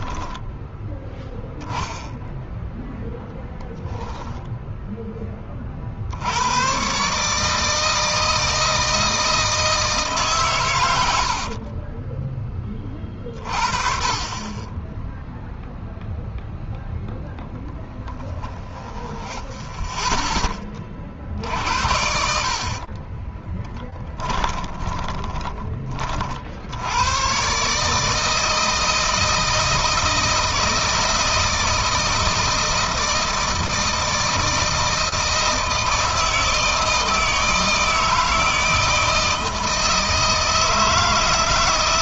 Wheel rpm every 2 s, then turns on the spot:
0, 0, 10, 130, 160, 110, 20, 10, 0, 20, 30, 50, 20, 70, 160, 160, 160, 160, 160, 160, 160.
10-12 18-20 22-26